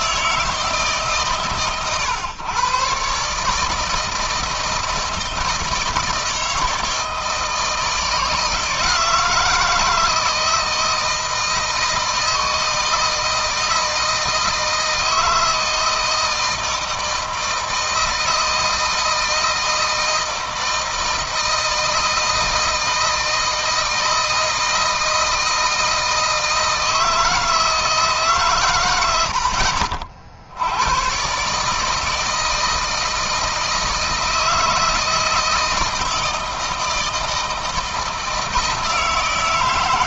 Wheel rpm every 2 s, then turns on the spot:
160, 130, 170, 160, 160, 160, 160, 160, 160, 160, 160, 160, 160, 160, 130, 80, 160, 160, 160, 160.
none